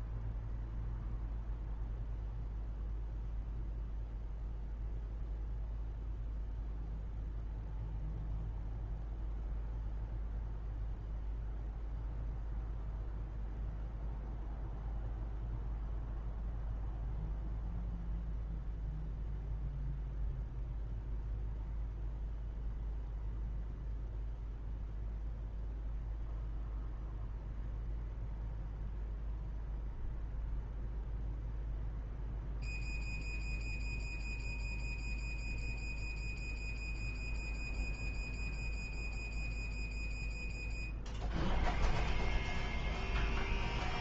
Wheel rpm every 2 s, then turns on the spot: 0, 0, 0, 0, 0, 0, 0, 0, 0, 0, 0, 0, 0, 0, 0, 0, 0, 0, 0, 0, 0, 0.
none